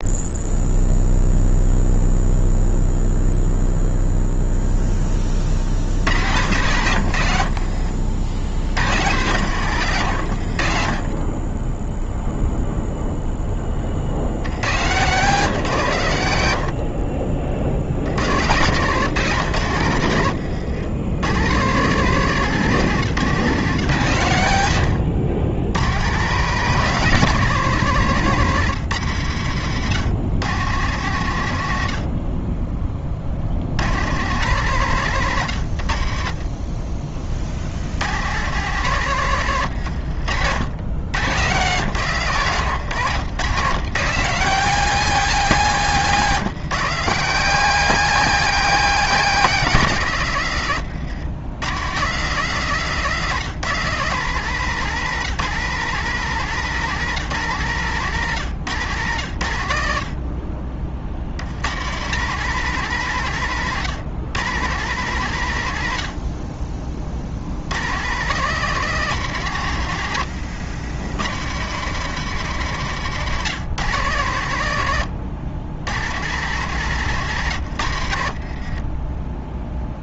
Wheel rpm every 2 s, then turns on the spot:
0, 0, 20, 80, 120, 30, 0, 130, 40, 140, 110, 150, 110, 180, 120, 110, 40, 130, 40, 120, 100, 130, 190, 170, 180, 110, 150, 170, 160, 110, 60, 140, 130, 50, 170, 100, 130, 100, 140, 20.
6-8 16-18 24-26 40-42 78-80